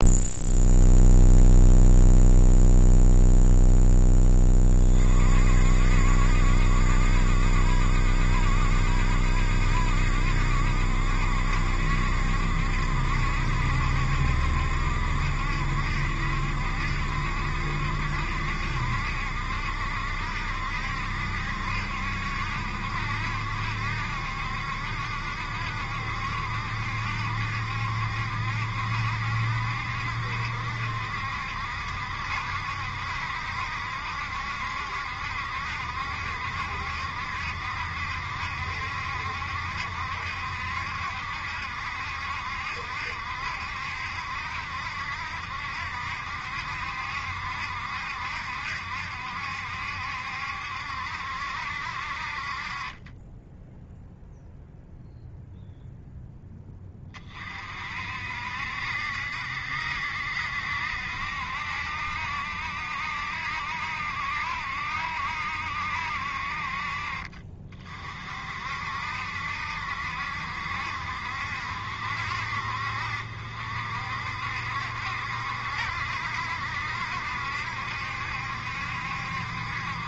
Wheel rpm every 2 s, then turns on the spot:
0, 0, 30, 60, 70, 70, 70, 70, 70, 70, 70, 70, 70, 70, 70, 70, 70, 70, 70, 70, 70, 70, 70, 70, 70, 70, 40, 0, 10, 60, 70, 70, 70, 50, 50, 60, 60, 70, 70, 70.
none